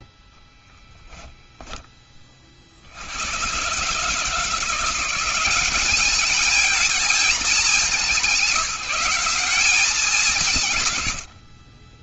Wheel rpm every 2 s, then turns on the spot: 0, 40, 160, 220, 190, 180.
none